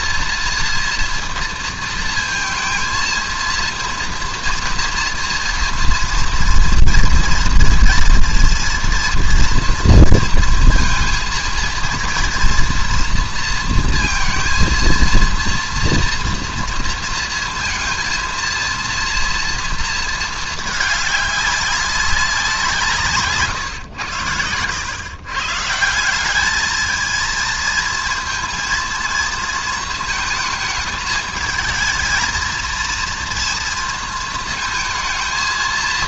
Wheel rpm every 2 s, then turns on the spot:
240, 230, 230, 230, 230, 230, 230, 230, 230, 230, 220, 180, 100, 210, 230, 220, 230, 220.
none